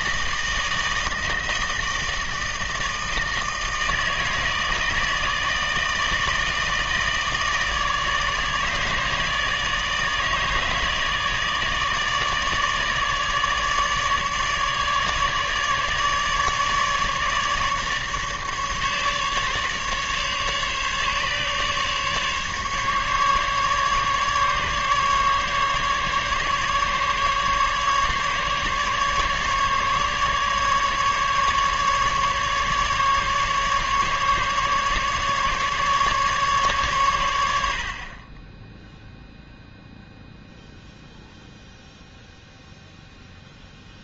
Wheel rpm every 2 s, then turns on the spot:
160, 160, 160, 160, 150, 160, 150, 150, 150, 150, 140, 150, 140, 150, 140, 140, 150, 150, 130, 0, 0, 0.
none